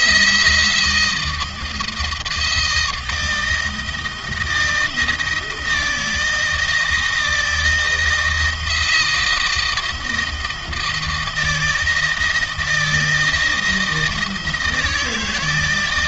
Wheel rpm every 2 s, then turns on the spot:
160, 170, 160, 160, 160, 160, 160, 160.
none